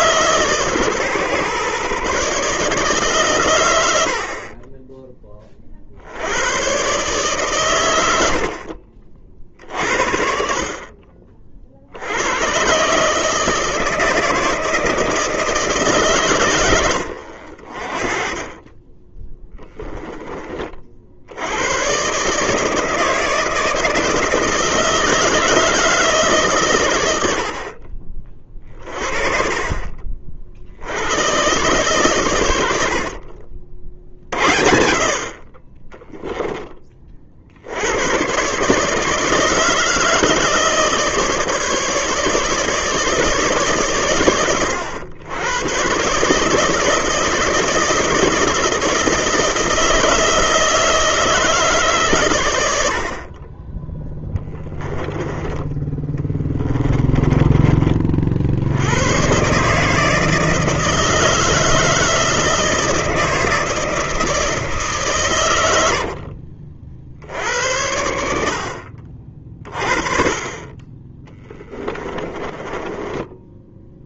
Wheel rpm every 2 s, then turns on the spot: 140, 140, 20, 130, 40, 50, 140, 160, 90, 20, 40, 160, 160, 120, 40, 70, 70, 50, 20, 150, 150, 160, 110, 160, 160, 160, 70, 10, 20, 90, 160, 160, 140, 60, 50, 30, 20.
8-10 56-58 72-74